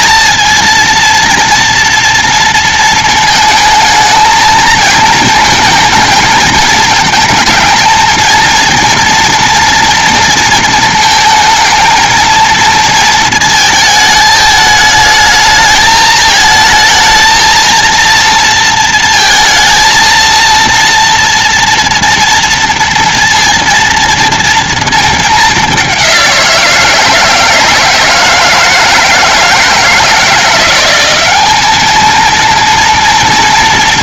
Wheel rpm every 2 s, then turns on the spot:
230, 230, 220, 220, 220, 230, 230, 220, 220, 230, 230, 230, 230, 180, 160, 170, 230.
none